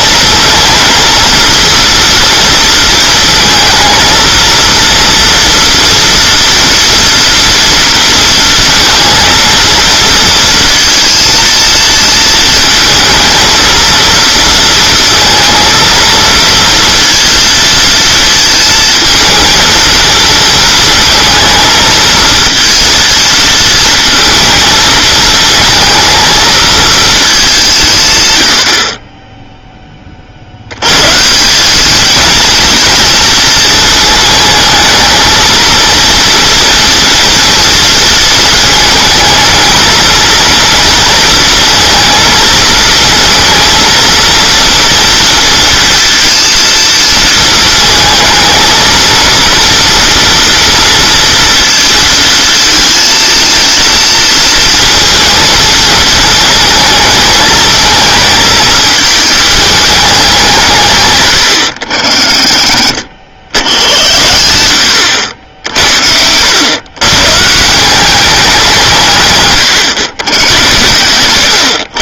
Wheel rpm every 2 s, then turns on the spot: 230, 230, 230, 240, 230, 230, 220, 230, 230, 230, 230, 230, 230, 220, 60, 80, 230, 220, 230, 220, 230, 230, 230, 230, 220, 230, 220, 230, 220, 220, 160, 60, 80, 110, 180, 100.
none